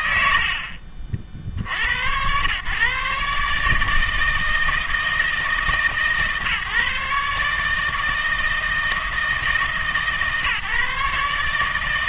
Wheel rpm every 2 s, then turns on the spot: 90, 120, 160, 140, 160, 150.
none